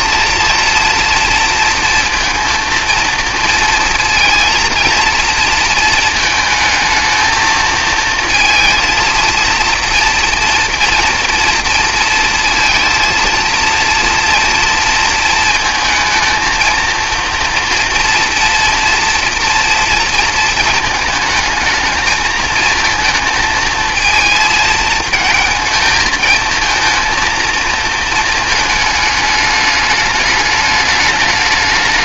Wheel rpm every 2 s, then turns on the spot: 230, 230, 230, 220, 230, 230, 220, 230, 230, 230, 230, 220, 220, 220, 220, 210.
none